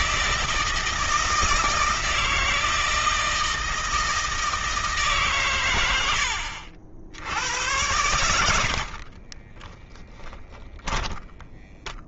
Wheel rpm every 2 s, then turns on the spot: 160, 160, 150, 70, 50, 20.
8-12